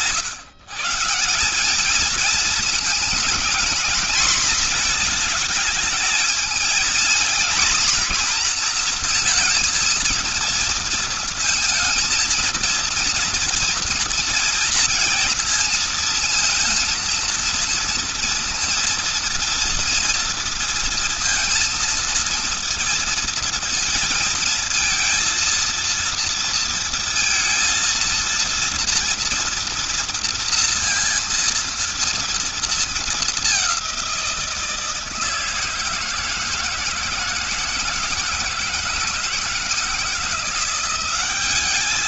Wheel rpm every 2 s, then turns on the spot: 150, 220, 230, 230, 230, 230, 230, 230, 230, 230, 230, 230, 220, 230, 230, 230, 230, 170, 160, 160, 170.
none